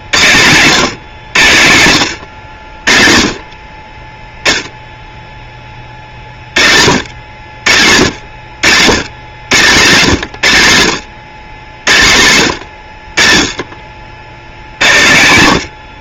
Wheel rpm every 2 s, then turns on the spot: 120, 60, 0, 70, 90, 110, 80, 90.
none